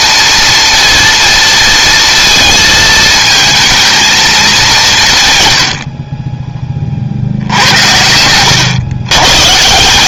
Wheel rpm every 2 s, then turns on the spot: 230, 220, 170, 40, 110.
none